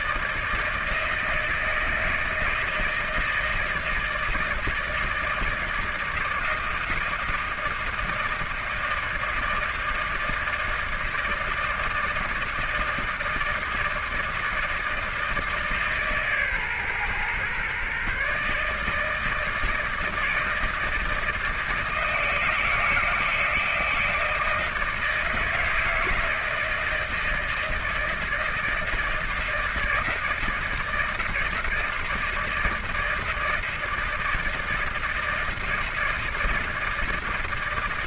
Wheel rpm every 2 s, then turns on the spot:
160, 160, 160, 160, 160, 160, 160, 160, 130, 150, 160, 160, 160, 160, 160, 160, 160, 160, 160.
none